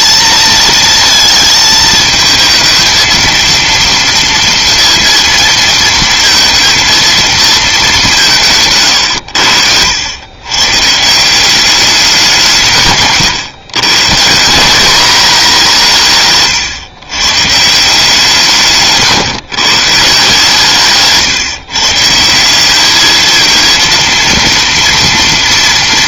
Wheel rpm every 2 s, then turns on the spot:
220, 220, 230, 230, 150, 130, 160, 180, 140, 150, 150, 190, 230.
none